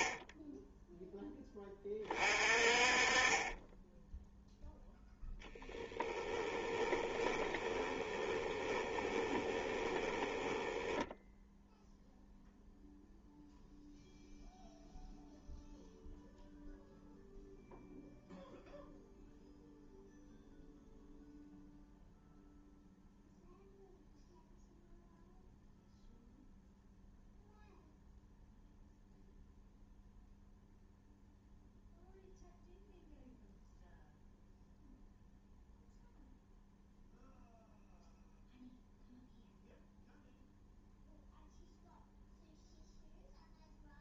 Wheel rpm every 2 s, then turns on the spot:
0, 30, 10, 20, 20, 10, 0, 0, 0, 0, 0, 0, 0, 0, 0, 0, 0, 0, 0, 0, 0, 0.
6-12